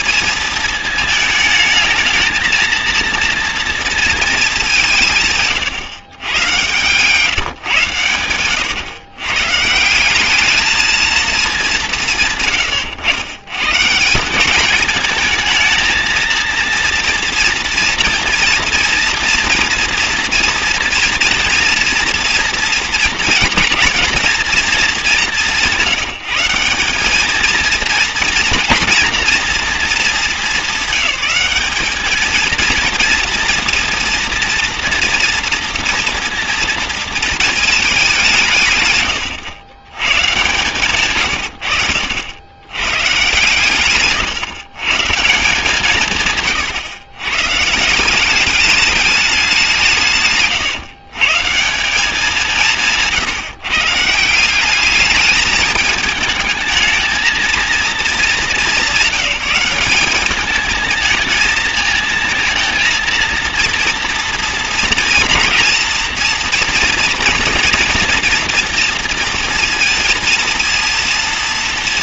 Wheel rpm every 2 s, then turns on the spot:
220, 230, 180, 130, 110, 220, 130, 200, 230, 230, 230, 230, 210, 190, 230, 200, 230, 230, 230, 140, 130, 110, 130, 130, 200, 130, 170, 190, 220, 200, 210, 230, 220, 230, 240, 230.
6-8